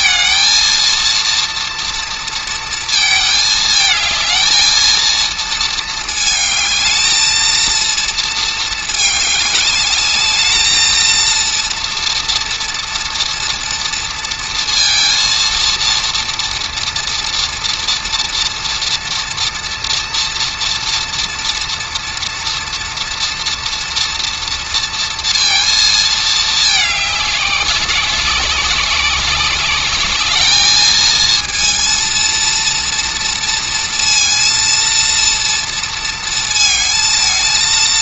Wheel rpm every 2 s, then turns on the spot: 230, 230, 220, 220, 210, 220, 230, 230, 240, 240, 230, 230, 230, 210, 190, 220, 230, 230, 220.
none